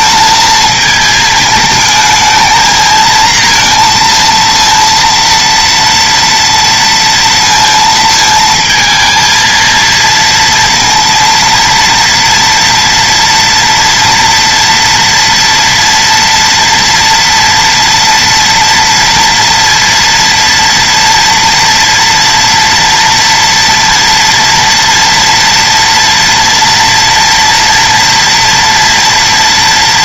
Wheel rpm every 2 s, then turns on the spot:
230, 220, 230, 230, 220, 230, 230, 230, 230, 230, 230, 230, 230, 230, 230.
none